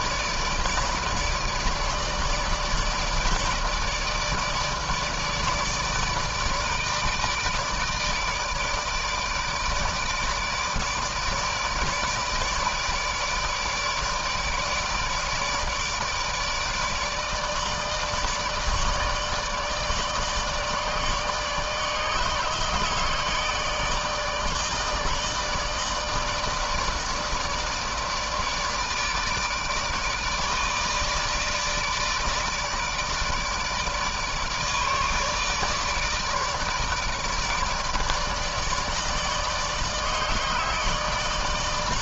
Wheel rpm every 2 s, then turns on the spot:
150, 160, 150, 160, 150, 160, 160, 150, 150, 150, 150, 150, 150, 160, 150, 160, 150, 150, 150, 150, 160.
none